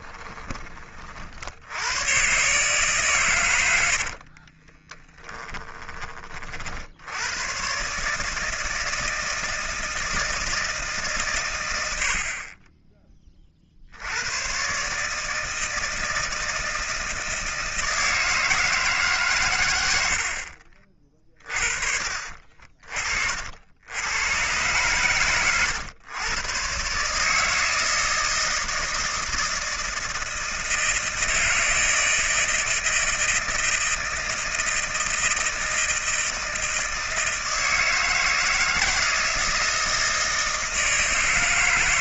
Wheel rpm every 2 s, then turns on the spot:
20, 140, 30, 50, 160, 160, 30, 110, 160, 160, 60, 50, 110, 130, 160, 160, 160, 160, 160, 160, 160.
4-6 20-22